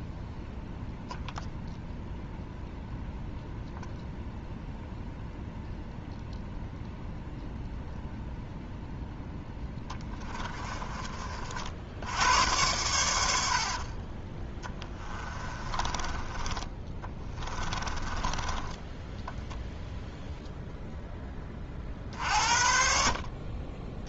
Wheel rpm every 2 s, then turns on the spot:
0, 0, 0, 0, 0, 20, 100, 10, 20, 10, 0, 50.
10-12 14-20